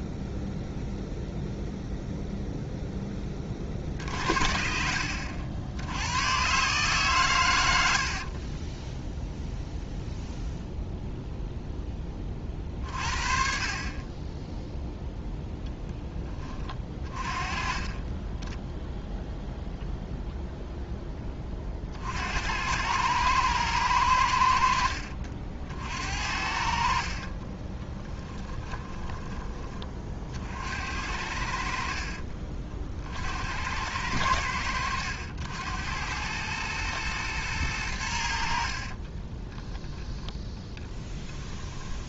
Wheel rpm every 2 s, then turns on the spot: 0, 10, 60, 130, 10, 0, 40, 0, 30, 10, 10, 100, 60, 60, 20, 80, 50, 90, 110, 50, 10.
8-10 18-20 26-30 38-42